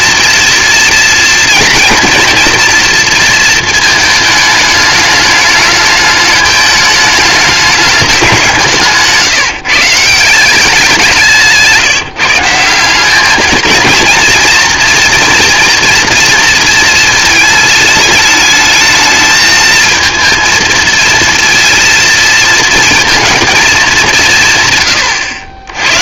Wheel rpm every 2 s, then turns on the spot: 230, 230, 210, 210, 170, 180, 170, 230, 230, 210, 230, 230, 130.
none